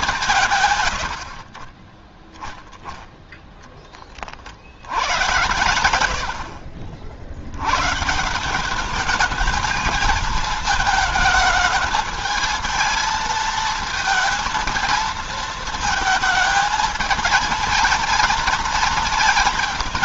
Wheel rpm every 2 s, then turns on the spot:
120, 0, 70, 60, 200, 220, 220, 230, 220, 220.
none